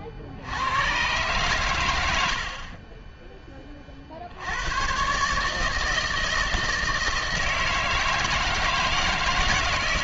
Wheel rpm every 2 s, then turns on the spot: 90, 60, 90, 160, 160.
none